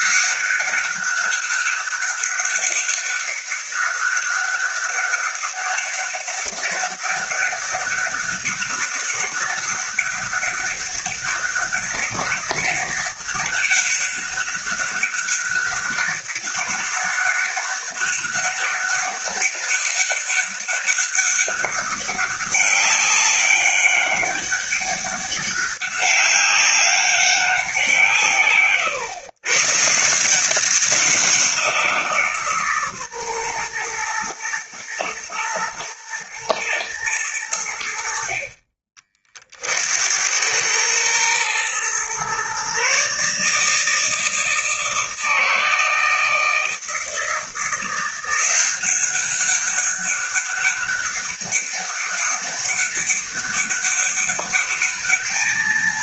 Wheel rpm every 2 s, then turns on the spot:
200, 200, 200, 200, 200, 200, 200, 200, 200, 200, 200, 200, 200, 200, 130, 190, 140, 120, 110, 40, 110, 140, 160, 160, 180, 200, 200, 210.
none